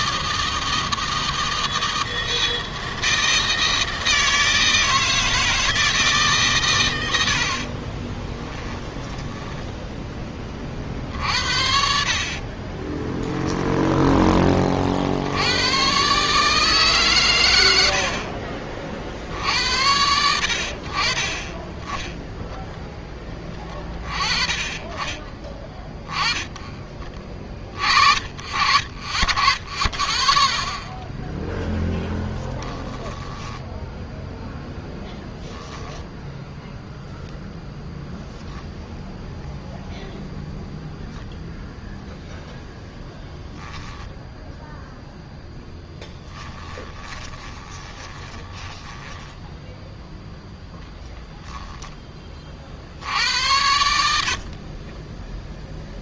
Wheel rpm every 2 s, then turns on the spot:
160, 160, 160, 110, 10, 50, 30, 40, 140, 50, 60, 10, 30, 20, 40, 0, 10, 0, 0, 0, 0, 0, 0, 20, 20, 0, 50, 30.
6-10 12-14 32-34 46-50 54-56